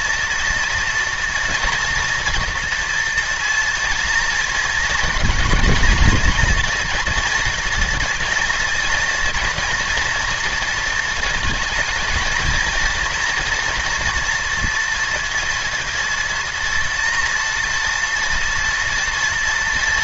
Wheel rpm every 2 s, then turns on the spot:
230, 240, 230, 230, 240, 230, 230, 230, 230, 240.
none